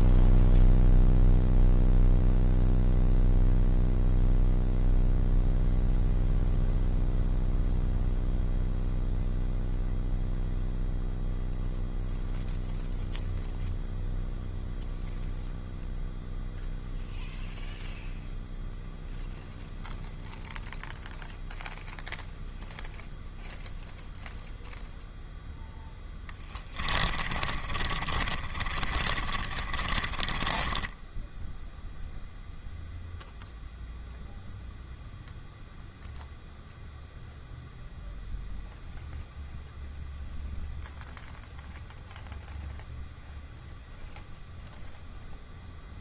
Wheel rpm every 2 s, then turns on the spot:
0, 0, 0, 0, 0, 0, 0, 0, 0, 0, 0, 0, 0, 20, 30, 20, 0, 0, 0, 0, 0, 0, 0.
26-32